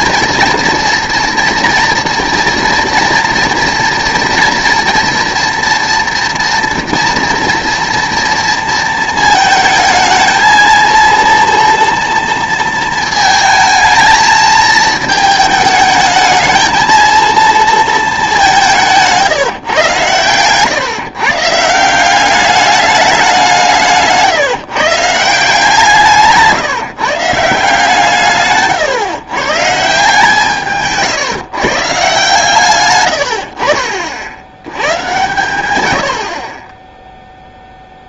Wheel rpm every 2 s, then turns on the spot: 240, 230, 230, 230, 230, 230, 220, 220, 220, 180, 140, 200, 150, 170, 130, 150, 130, 100, 10.
18-20